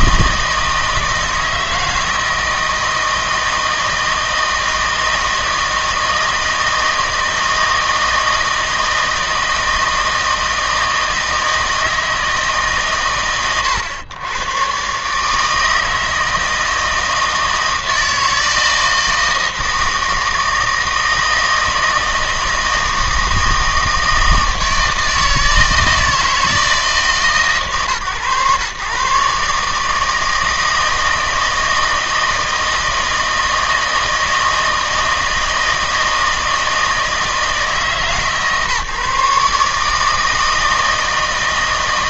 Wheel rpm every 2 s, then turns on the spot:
160, 160, 160, 160, 160, 160, 120, 130, 160, 160, 160, 160, 160, 160, 120, 160, 160, 160, 160, 150, 160.
none